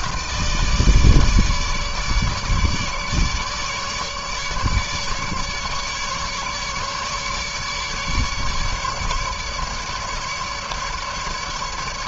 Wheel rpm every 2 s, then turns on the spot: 150, 150, 150, 150, 150, 150.
none